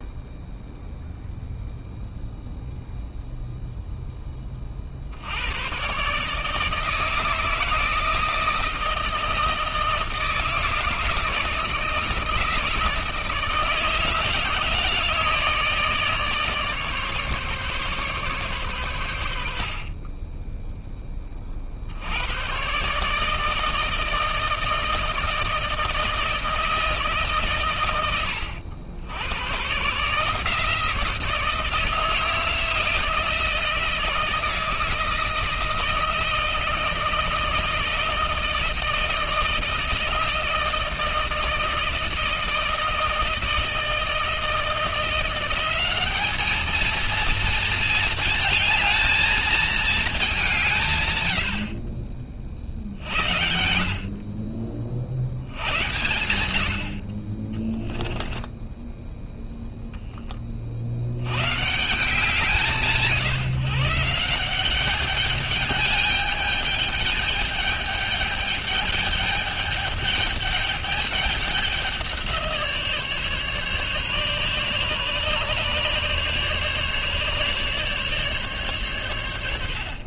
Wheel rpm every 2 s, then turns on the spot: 0, 0, 40, 160, 160, 160, 160, 160, 150, 120, 10, 130, 160, 160, 80, 160, 170, 160, 160, 160, 160, 160, 170, 220, 220, 150, 50, 30, 70, 10, 50, 170, 190, 210, 210, 210, 160, 140, 140, 130.
58-60